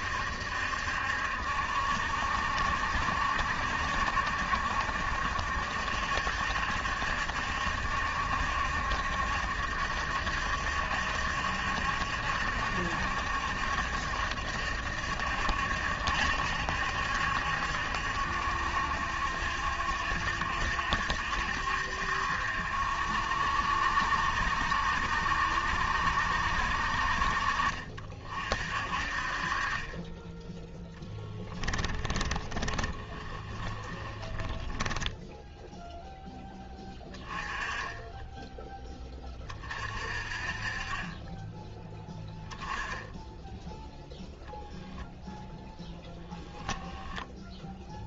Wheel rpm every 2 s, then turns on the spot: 70, 70, 70, 70, 70, 70, 70, 70, 70, 70, 70, 70, 70, 60, 40, 10, 20, 10, 10, 20, 30, 20, 0, 10.
30-36